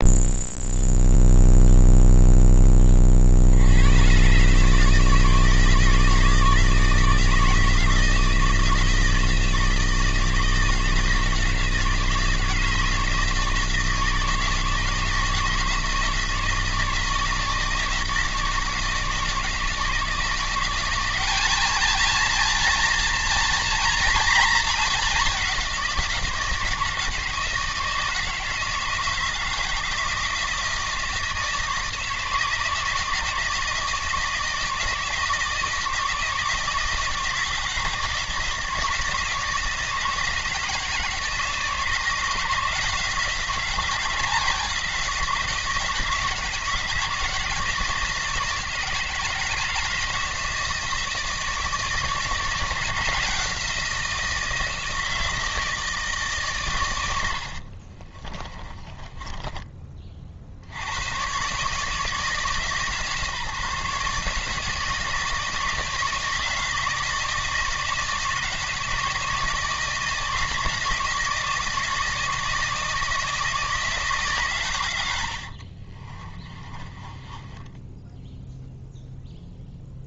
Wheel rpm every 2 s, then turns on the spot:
0, 20, 140, 160, 160, 160, 160, 160, 160, 160, 170, 230, 220, 160, 160, 160, 160, 160, 160, 160, 160, 170, 160, 160, 160, 160, 160, 160, 130, 30, 50, 150, 160, 160, 160, 160, 160, 110, 20, 0.
58-60 76-78